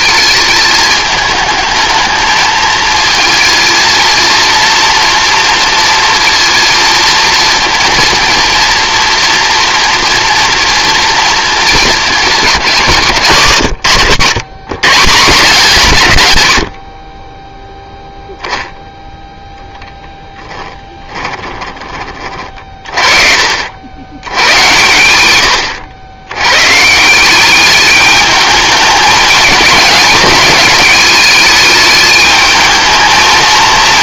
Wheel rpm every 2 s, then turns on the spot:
210, 220, 230, 230, 230, 230, 200, 150, 70, 0, 10, 40, 100, 140, 210, 210, 210.
20-22